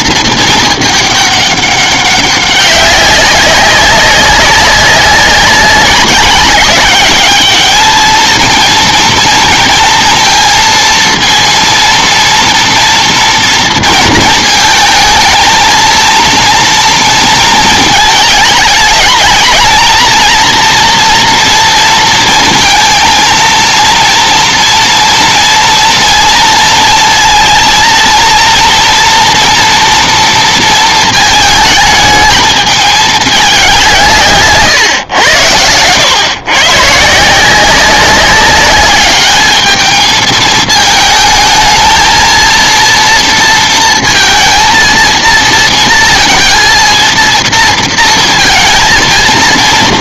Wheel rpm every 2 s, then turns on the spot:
220, 200, 190, 190, 220, 230, 230, 220, 230, 210, 230, 230, 230, 230, 230, 230, 210, 140, 130, 200, 220, 230, 230, 230, 230.
none